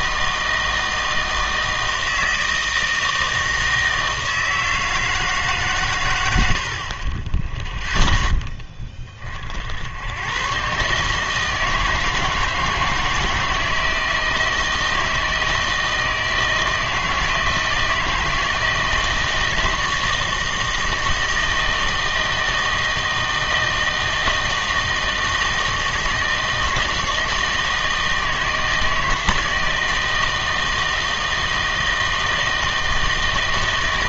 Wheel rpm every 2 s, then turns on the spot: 160, 160, 160, 60, 20, 140, 160, 160, 160, 160, 160, 160, 160, 160, 160, 160, 160.
none